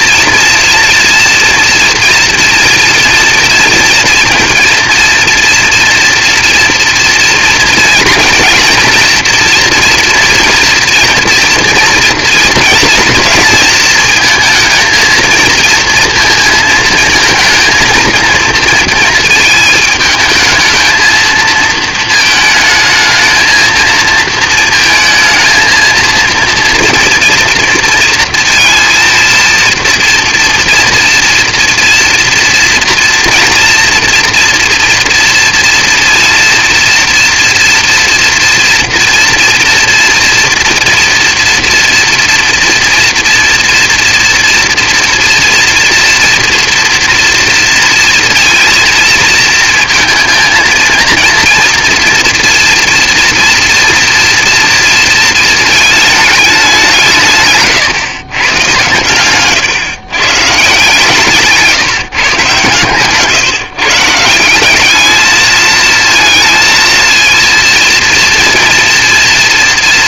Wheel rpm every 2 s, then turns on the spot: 230, 230, 230, 230, 230, 240, 230, 220, 230, 230, 220, 220, 230, 230, 230, 230, 230, 230, 230, 230, 230, 230, 230, 230, 230, 230, 230, 230, 210, 120, 140, 140, 160, 230, 230.
none